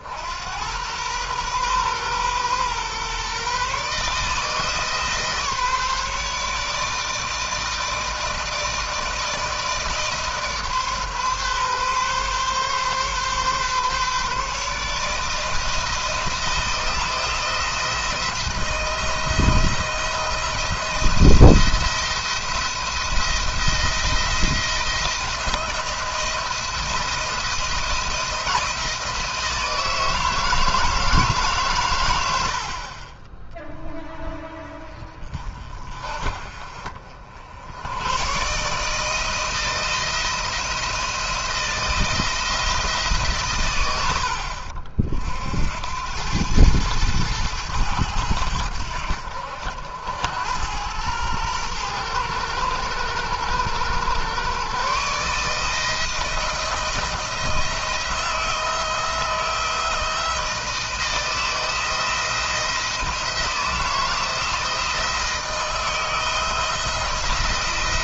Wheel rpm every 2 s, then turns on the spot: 100, 130, 150, 160, 160, 140, 140, 150, 170, 170, 170, 170, 170, 170, 160, 160, 50, 30, 50, 140, 170, 160, 60, 110, 80, 100, 100, 140, 170, 160, 160, 170, 160, 160.
none